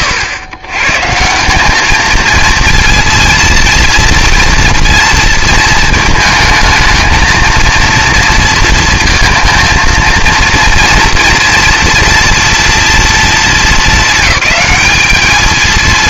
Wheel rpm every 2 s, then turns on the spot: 130, 220, 230, 220, 230, 230, 230, 200.
none